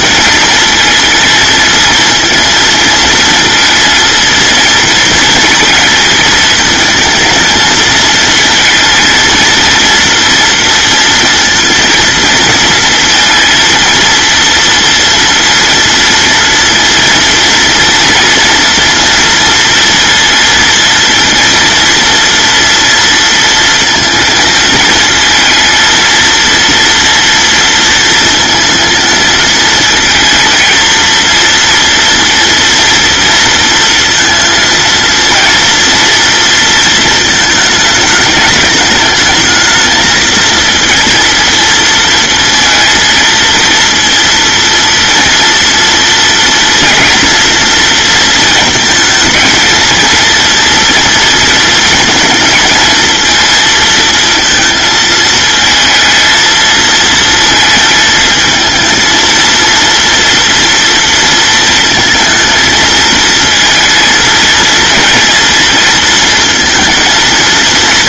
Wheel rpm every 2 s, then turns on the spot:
220, 220, 230, 230, 230, 230, 230, 230, 240, 230, 230, 230, 230, 230, 220, 230, 230, 230, 230, 210, 230, 230, 230, 240, 230, 230, 230, 220, 230, 220, 230, 220, 230, 230.
none